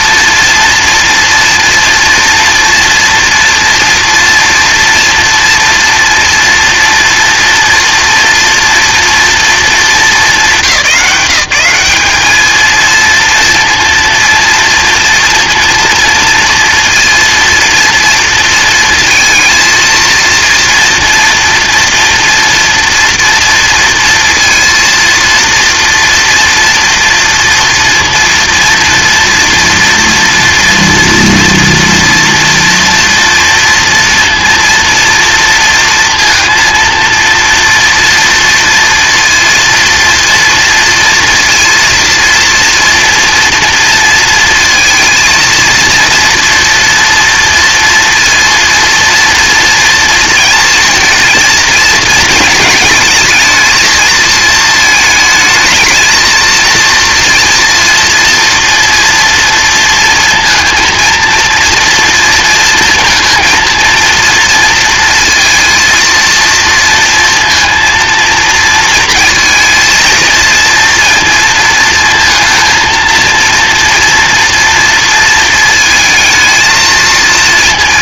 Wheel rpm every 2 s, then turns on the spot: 230, 230, 230, 240, 240, 190, 230, 230, 230, 230, 230, 230, 230, 230, 230, 230, 230, 230, 230, 230, 230, 230, 230, 240, 230, 230, 220, 220, 230, 230, 230, 220, 230, 230, 230, 230, 230, 230, 220.
none